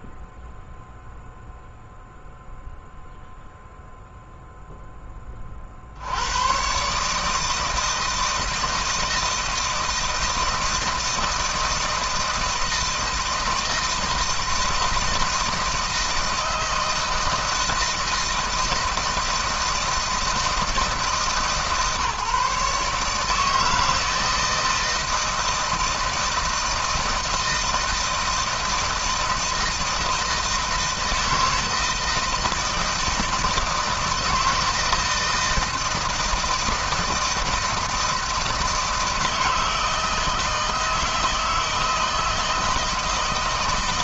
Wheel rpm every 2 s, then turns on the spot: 0, 0, 10, 140, 160, 160, 160, 160, 160, 160, 160, 150, 160, 160, 160, 160, 160, 160, 160, 160, 160, 160.
none